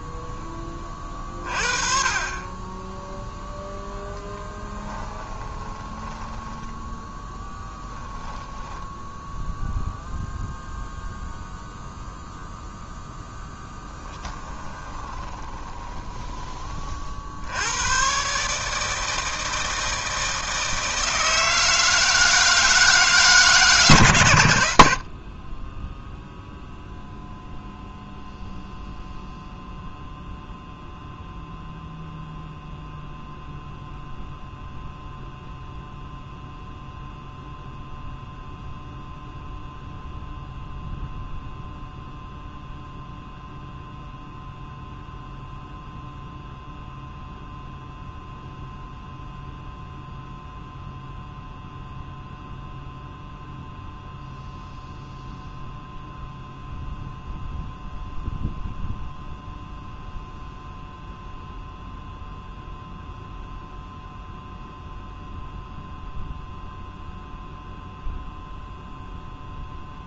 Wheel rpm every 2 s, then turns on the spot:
30, 0, 10, 10, 0, 0, 0, 20, 60, 160, 160, 150, 40, 0, 0, 0, 0, 0, 0, 0, 0, 0, 0, 0, 0, 0, 0, 0, 0, 0, 0, 0, 0, 0, 0.
4-8 14-16